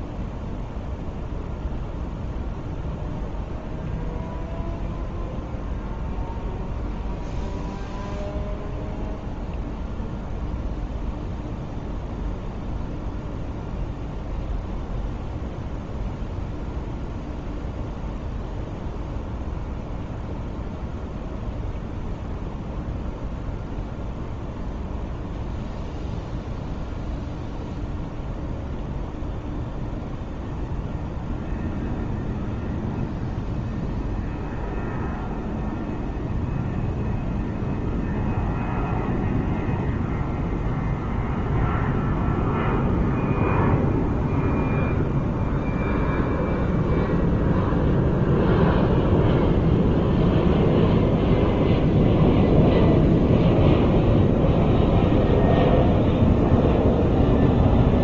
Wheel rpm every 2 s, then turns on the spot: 0, 0, 0, 0, 0, 0, 0, 0, 0, 0, 0, 0, 0, 0, 0, 0, 0, 0, 0, 0, 0, 0, 0, 0, 0, 0, 0, 0, 0.
none